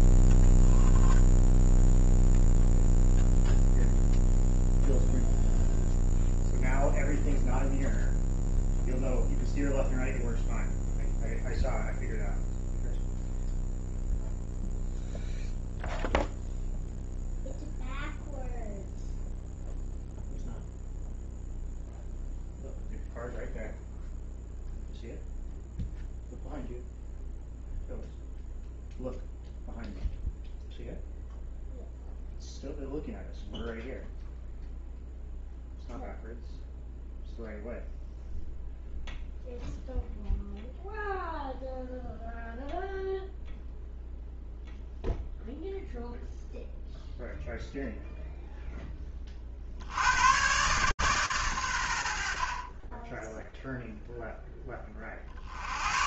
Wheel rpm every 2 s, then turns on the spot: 0, 0, 0, 0, 0, 0, 0, 0, 0, 0, 0, 0, 0, 0, 0, 0, 0, 0, 0, 0, 0, 0, 0, 0, 0, 120, 50, 10.
none